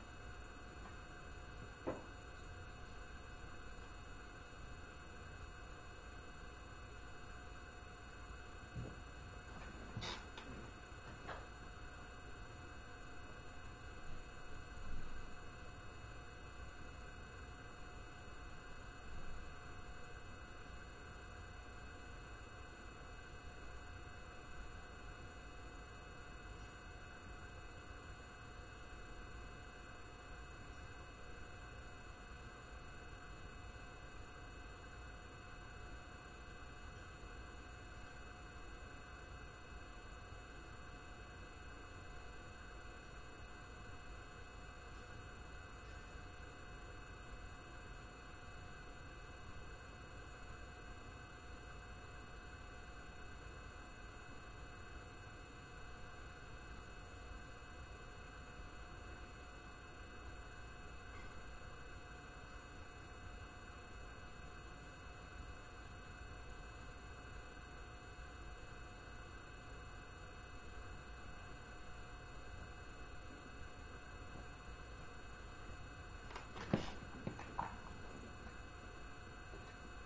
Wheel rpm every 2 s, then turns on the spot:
0, 0, 0, 0, 0, 0, 0, 0, 0, 0, 0, 0, 0, 0, 0, 0, 0, 0, 0, 0, 0, 0, 0, 0, 0, 0, 0, 0, 0, 0, 0, 0, 0, 0, 0, 0, 0, 0, 0, 0.
none